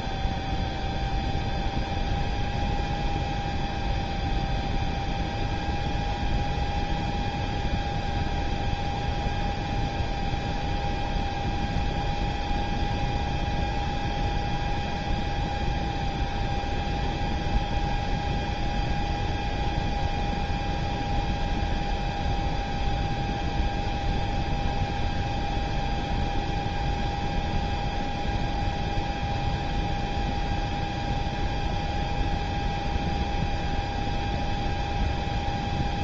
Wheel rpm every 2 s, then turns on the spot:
0, 0, 0, 0, 0, 0, 0, 0, 0, 0, 0, 0, 0, 0, 0, 0, 0, 0.
none